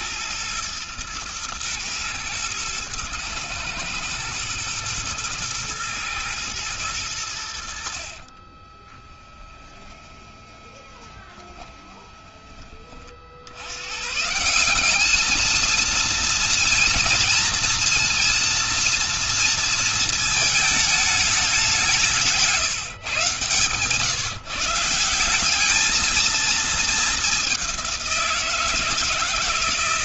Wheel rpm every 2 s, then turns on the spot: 110, 110, 110, 50, 20, 20, 130, 230, 240, 230, 180, 150, 220, 180, 130.
6-12